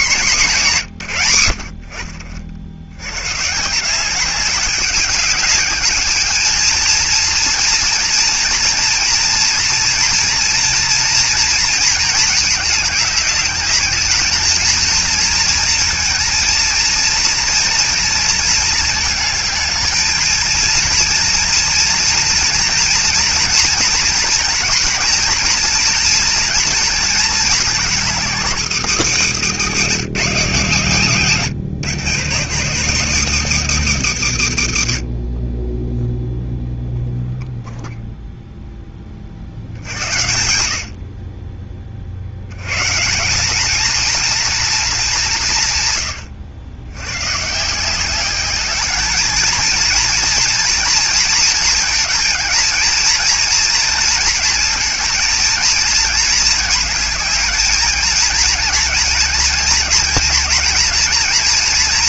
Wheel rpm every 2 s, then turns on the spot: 180, 70, 200, 220, 230, 240, 210, 220, 230, 220, 230, 230, 230, 230, 210, 200, 180, 110, 0, 10, 70, 120, 230, 90, 200, 230, 230, 230, 220, 220, 230.
none